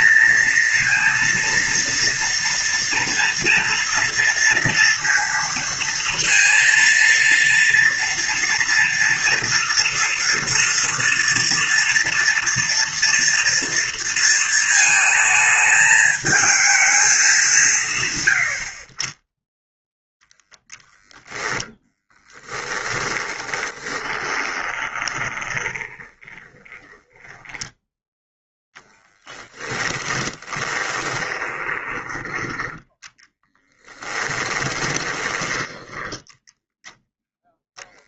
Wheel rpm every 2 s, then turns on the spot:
230, 230, 230, 230, 230, 230, 230, 220, 210, 40, 10, 10, 20, 10, 0, 20, 10, 20, 0.
22-28 30-36